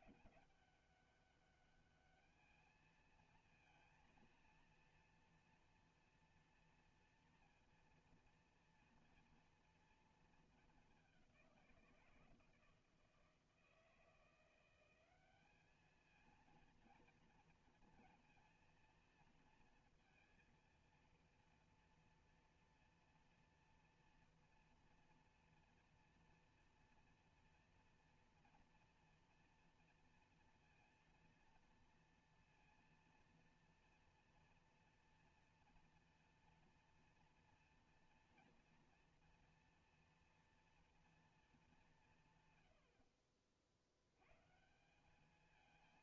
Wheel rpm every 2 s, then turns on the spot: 200, 220, 230, 230, 230, 220, 160, 170, 230, 230, 230, 240, 230, 230, 240, 240, 230, 240, 230, 230, 230, 130, 130.
none